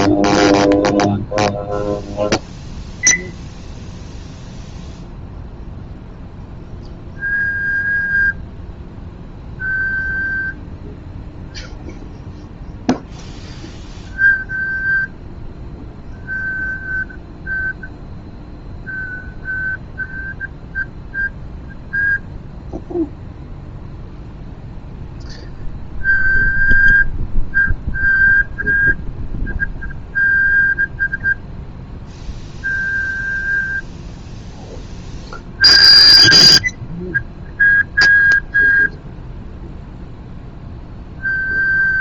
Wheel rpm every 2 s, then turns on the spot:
0, 0, 0, 0, 0, 0, 0, 0, 0, 0, 0, 0, 0, 0, 0, 0, 0, 0, 0, 0, 0.
none